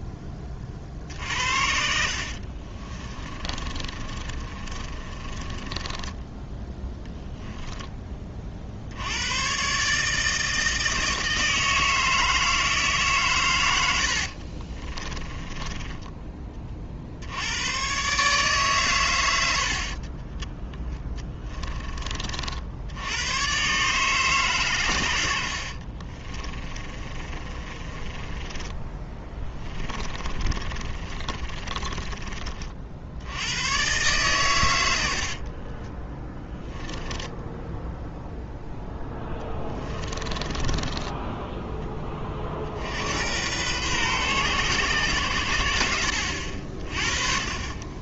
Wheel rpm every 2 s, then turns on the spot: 30, 50, 30, 10, 40, 160, 160, 50, 30, 130, 10, 50, 130, 30, 20, 30, 50, 120, 10, 0, 20, 50, 120, 50.
2-6 14-16 26-32 36-38 40-42